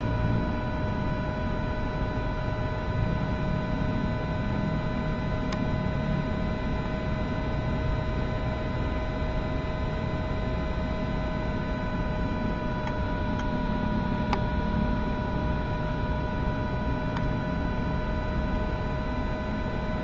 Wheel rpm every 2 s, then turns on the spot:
0, 0, 0, 0, 0, 0, 0, 0, 0, 0.
none